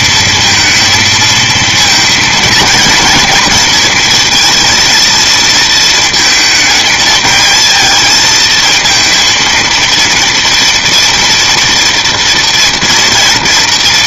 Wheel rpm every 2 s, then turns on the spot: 230, 220, 230, 220, 220, 230, 230.
none